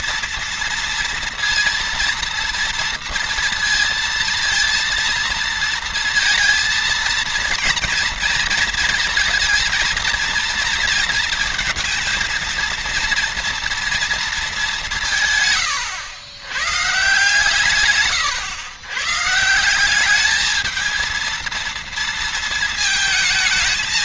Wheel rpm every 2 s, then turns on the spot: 230, 230, 230, 230, 230, 230, 230, 180, 140, 130, 220, 220.
none